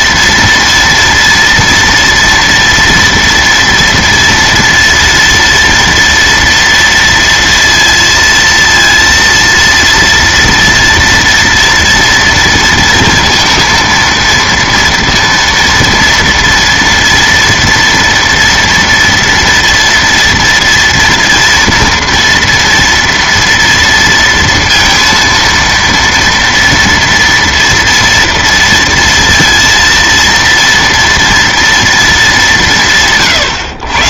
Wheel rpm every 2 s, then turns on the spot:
230, 230, 230, 230, 230, 230, 230, 230, 230, 230, 230, 230, 230, 230, 230, 230, 180.
none